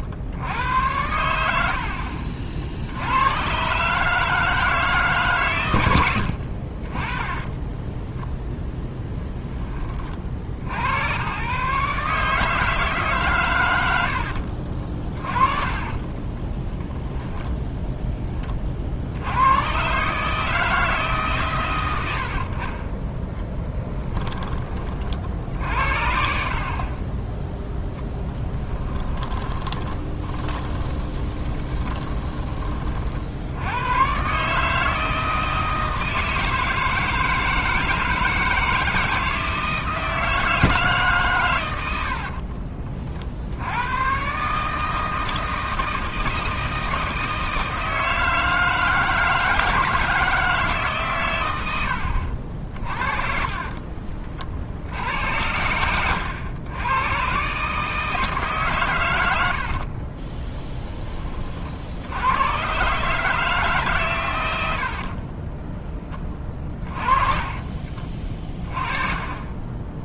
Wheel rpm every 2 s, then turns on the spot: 90, 80, 150, 40, 10, 100, 150, 50, 10, 50, 150, 30, 40, 30, 20, 30, 40, 160, 160, 160, 160, 50, 160, 160, 160, 150, 40, 70, 110, 130, 20, 130, 70, 30, 30.
14-18 22-24 28-32 60-62 66-68